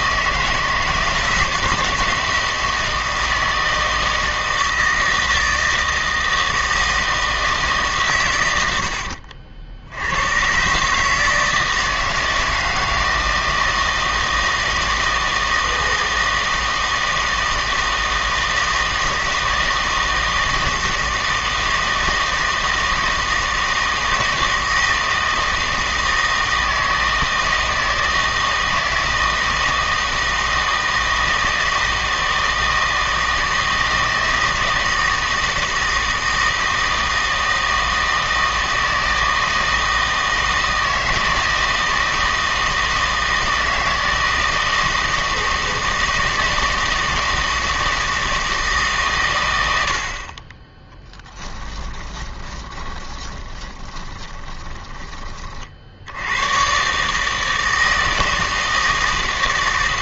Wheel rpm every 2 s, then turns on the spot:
160, 170, 160, 160, 100, 130, 160, 160, 160, 160, 160, 160, 160, 160, 160, 160, 160, 160, 160, 160, 160, 160, 160, 160, 160, 20, 20, 20, 110, 160.
52-56